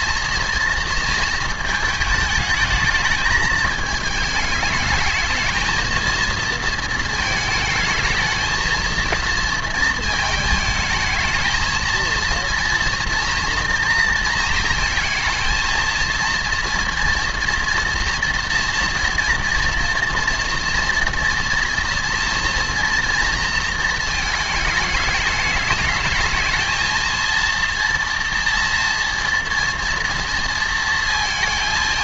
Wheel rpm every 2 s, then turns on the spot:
230, 220, 220, 220, 220, 220, 240, 230, 230, 230, 230, 230, 210, 220, 240, 230.
none